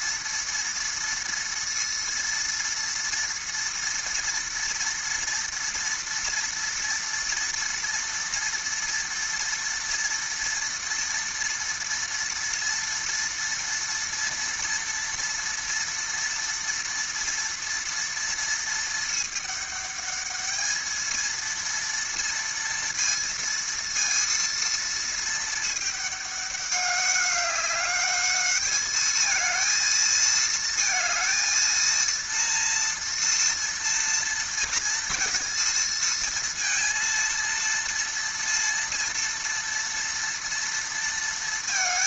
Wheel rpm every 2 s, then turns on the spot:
230, 230, 230, 230, 230, 230, 230, 230, 230, 220, 220, 230, 230, 200, 220, 220, 230, 230, 230, 230, 230.
none